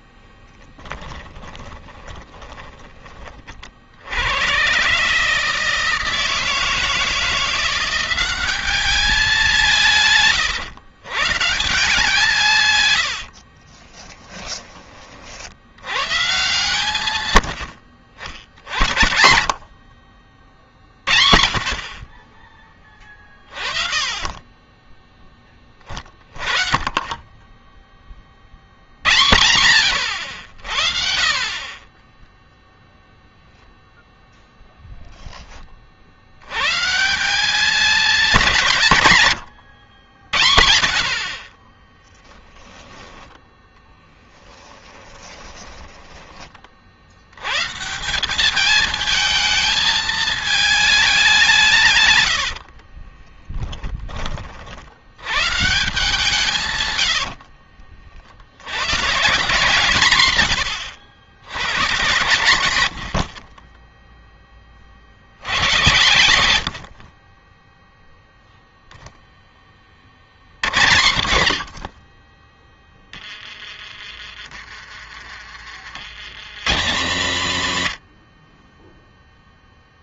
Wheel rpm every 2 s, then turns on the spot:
20, 20, 140, 160, 200, 130, 100, 30, 130, 70, 50, 40, 10, 30, 80, 50, 0, 0, 150, 160, 50, 10, 10, 60, 220, 210, 40, 80, 100, 130, 100, 80, 50, 50, 0, 50, 30, 30, 150, 20.
0-2 12-14 22-26 44-46 52-54 62-64 72-74